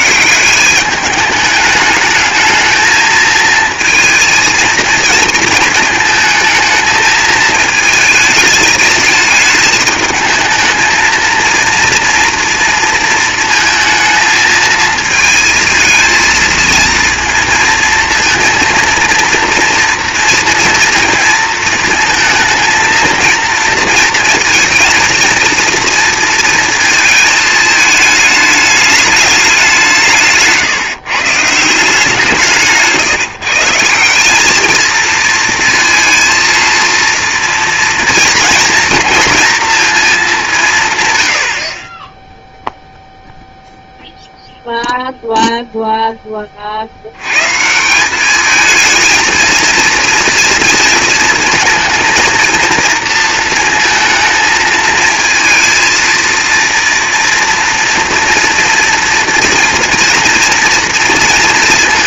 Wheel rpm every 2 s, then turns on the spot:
200, 220, 230, 220, 220, 220, 230, 220, 230, 230, 230, 220, 220, 230, 210, 150, 150, 220, 230, 230, 160, 0, 0, 50, 220, 230, 230, 230, 230, 230, 230.
none